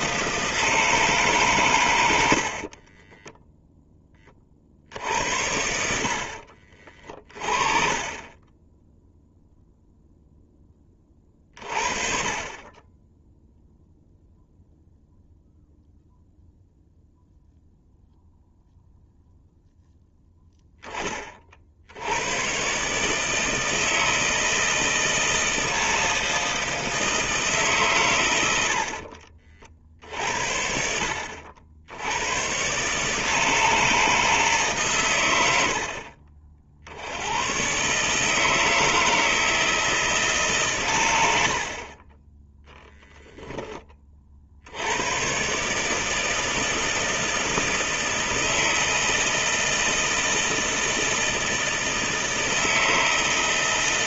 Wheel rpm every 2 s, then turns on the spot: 150, 30, 60, 40, 10, 20, 20, 0, 0, 0, 10, 140, 160, 160, 60, 60, 120, 140, 60, 160, 130, 0, 80, 160, 160, 160, 160.
2-4